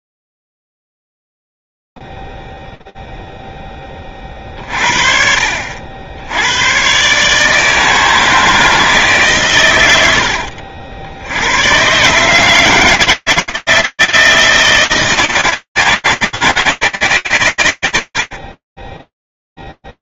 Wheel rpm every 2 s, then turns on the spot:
0, 0, 10, 60, 150, 130, 100, 160, 160, 10.
none